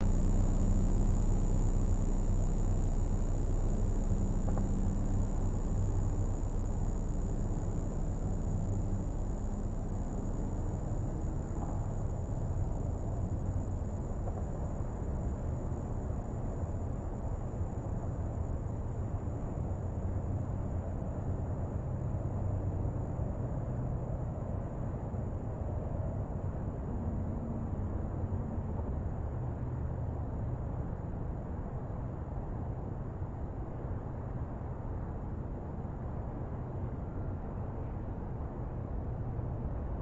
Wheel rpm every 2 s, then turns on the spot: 0, 0, 0, 0, 0, 0, 0, 0, 0, 0, 0, 0, 0, 0, 0, 0, 0, 0, 0, 0.
none